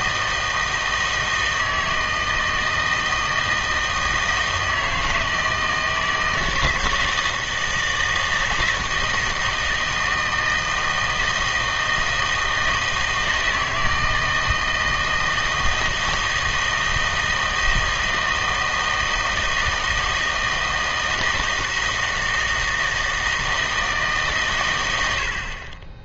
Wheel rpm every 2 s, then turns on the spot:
160, 160, 160, 160, 160, 160, 160, 160, 160, 160, 160, 160, 130.
none